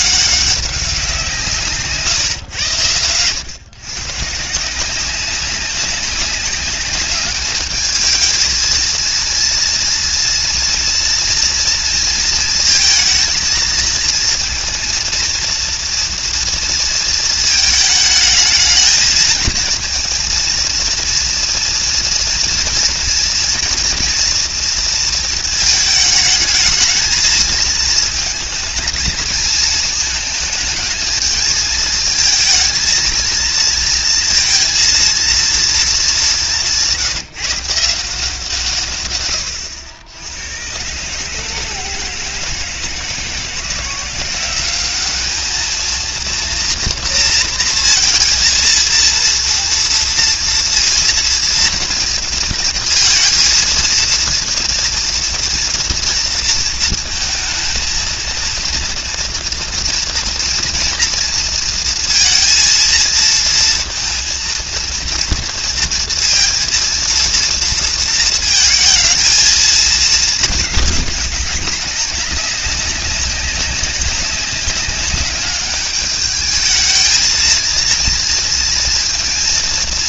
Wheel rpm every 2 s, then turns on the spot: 190, 110, 180, 200, 230, 230, 230, 230, 230, 220, 230, 230, 230, 210, 220, 220, 230, 230, 170, 140, 120, 160, 200, 230, 230, 230, 230, 230, 230, 230, 230, 230, 230, 230, 230, 210, 200, 200, 220, 230.
none